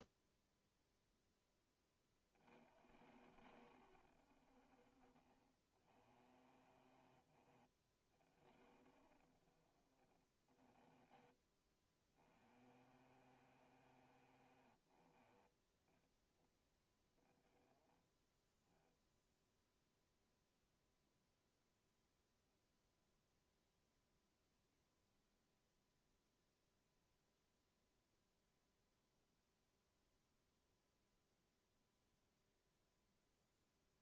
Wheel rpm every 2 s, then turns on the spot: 0, 80, 40, 20, 50, 10, 30, 10, 10, 0, 0, 0, 0, 0, 0, 0, 0.
10-16